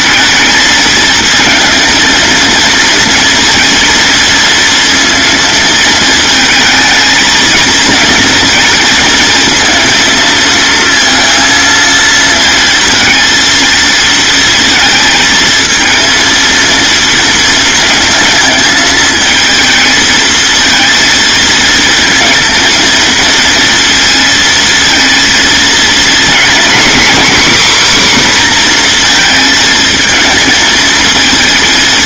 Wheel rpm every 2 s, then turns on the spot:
220, 230, 230, 220, 230, 230, 230, 220, 230, 220, 230, 230, 230, 260, 240, 220.
none